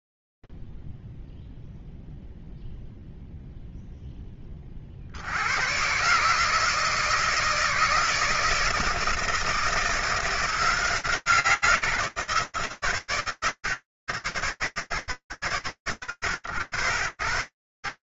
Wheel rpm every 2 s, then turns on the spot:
0, 0, 0, 110, 160, 170, 140, 130, 80.
none